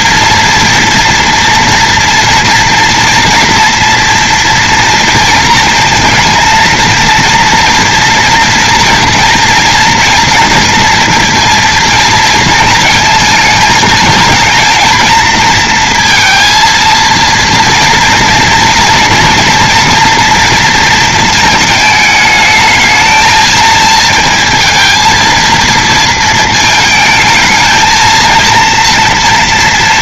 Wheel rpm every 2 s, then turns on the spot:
230, 240, 230, 230, 230, 230, 230, 220, 230, 230, 230, 220, 230, 230, 230.
none